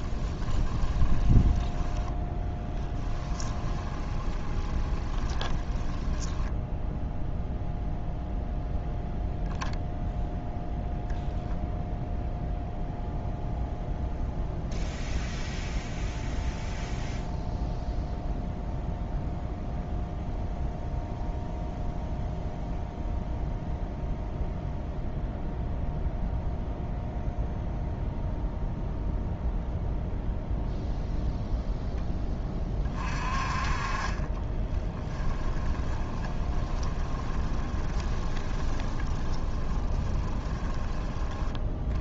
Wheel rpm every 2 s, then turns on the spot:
20, 10, 20, 0, 0, 0, 0, 0, 0, 0, 0, 0, 0, 0, 0, 0, 30, 20, 20, 20, 20.
0-6 34-40